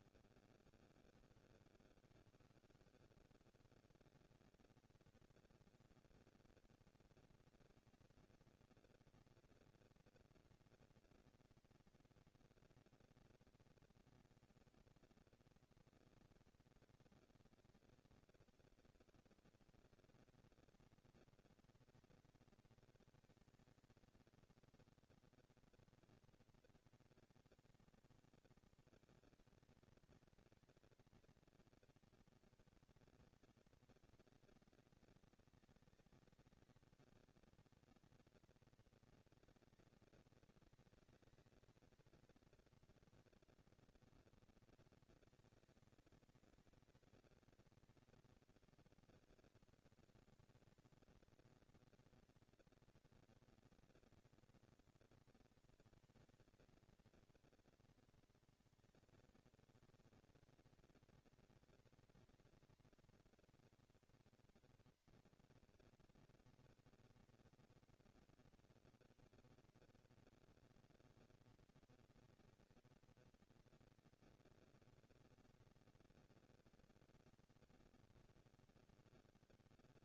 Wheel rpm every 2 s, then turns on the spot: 90, 150, 220, 230, 230, 230, 230, 230, 230, 230, 230, 230, 230, 230, 220, 220, 200, 200, 200, 230, 220, 230, 230, 230, 230, 230, 230, 230, 230, 230, 230, 240, 230, 230, 230, 230, 230, 230, 230, 170.
none